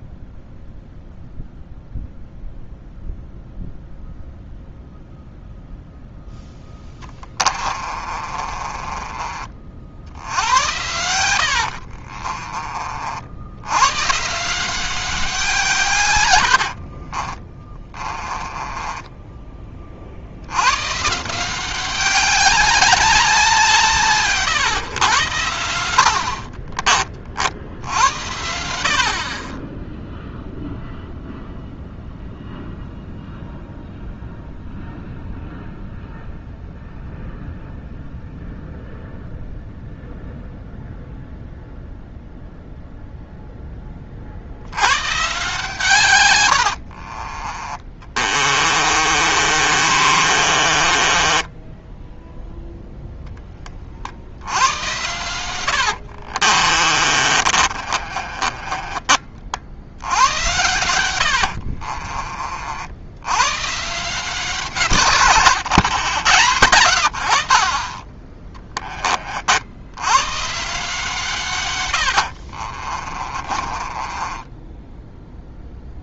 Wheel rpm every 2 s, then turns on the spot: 0, 0, 0, 20, 30, 90, 40, 180, 60, 20, 120, 200, 120, 30, 60, 0, 0, 0, 0, 0, 0, 0, 100, 70, 30, 30, 0, 100, 30, 30, 100, 70, 160, 90, 20, 150, 40, 10.
6-12 16-20 46-52 56-60 72-76